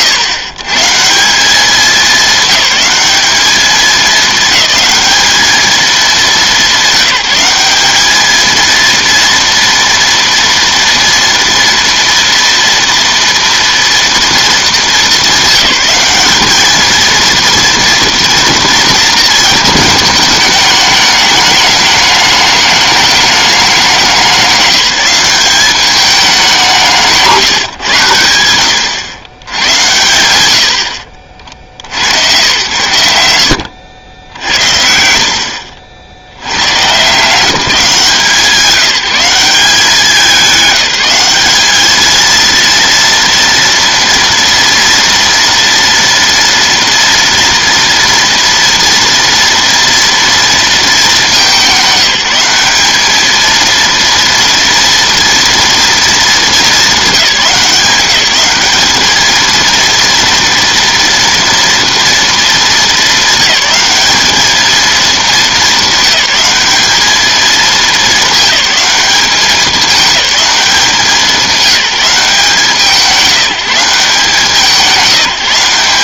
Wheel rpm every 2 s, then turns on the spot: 150, 200, 210, 200, 230, 240, 230, 210, 220, 230, 210, 210, 200, 180, 90, 80, 110, 70, 130, 180, 200, 230, 230, 230, 230, 230, 200, 230, 220, 210, 230, 220, 220, 200, 210, 200, 170, 180.
none